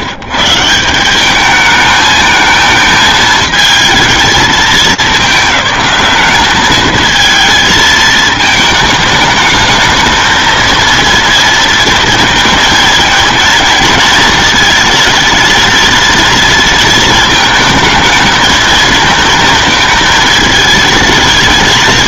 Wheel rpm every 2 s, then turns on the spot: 130, 220, 210, 210, 220, 220, 230, 220, 230, 220, 220.
none